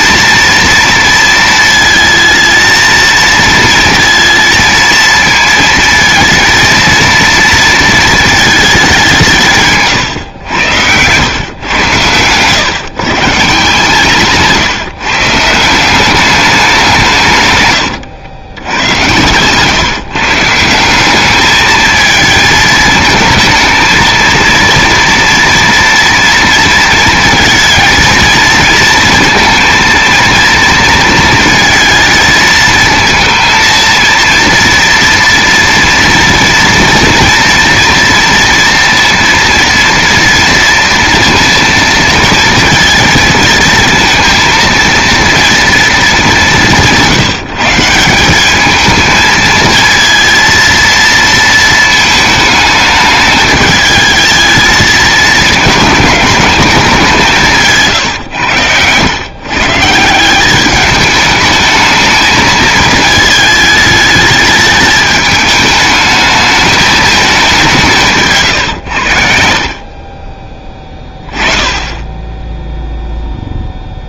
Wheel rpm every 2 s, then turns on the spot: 230, 220, 230, 230, 210, 100, 120, 150, 190, 100, 170, 220, 230, 230, 230, 230, 220, 230, 230, 230, 230, 230, 230, 180, 210, 230, 210, 220, 210, 110, 200, 220, 210, 210, 100, 20, 10.
10-12